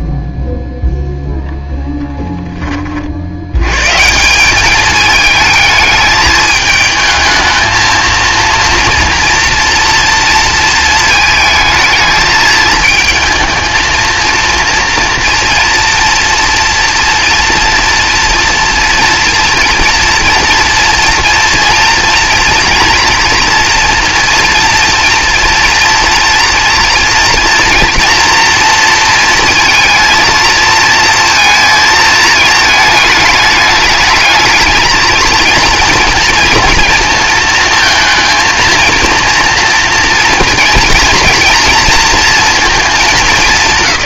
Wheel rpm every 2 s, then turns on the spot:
0, 20, 200, 220, 230, 220, 220, 230, 230, 240, 230, 230, 230, 230, 230, 230, 220, 220, 230, 230, 230, 220.
none